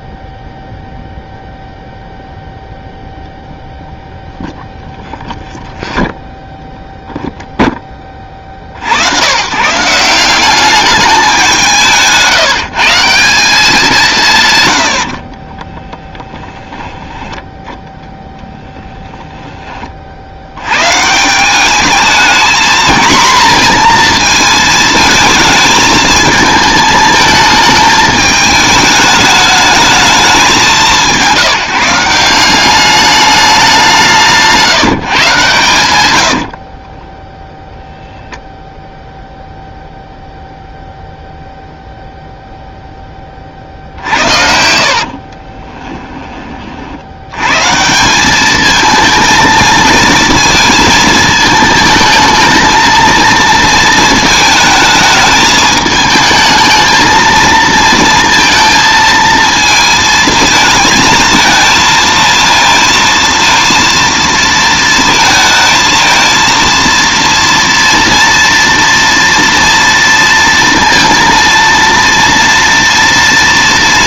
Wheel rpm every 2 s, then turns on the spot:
0, 0, 0, 0, 50, 200, 160, 120, 10, 10, 110, 230, 220, 220, 210, 180, 190, 160, 40, 0, 0, 0, 50, 50, 220, 230, 220, 220, 220, 230, 220, 230, 230, 230, 230, 230, 230.
16-18 36-38 44-46